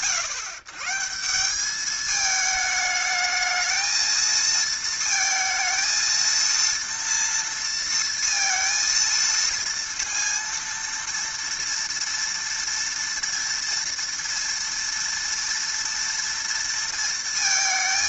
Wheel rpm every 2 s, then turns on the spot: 140, 220, 220, 230, 230, 230, 230, 230, 230.
none